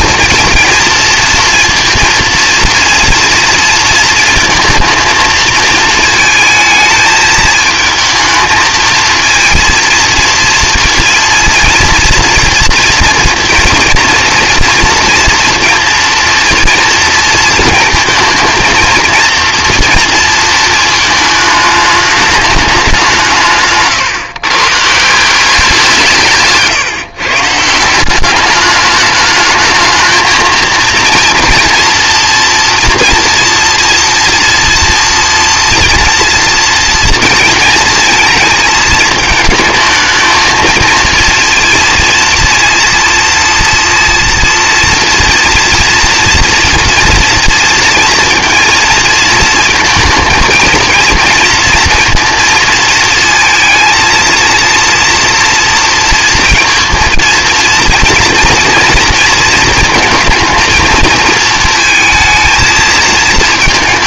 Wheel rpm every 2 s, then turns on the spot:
230, 230, 230, 220, 220, 230, 230, 230, 230, 230, 220, 200, 140, 150, 200, 230, 230, 240, 230, 220, 220, 230, 230, 230, 230, 230, 230, 230, 230, 230, 230, 230.
none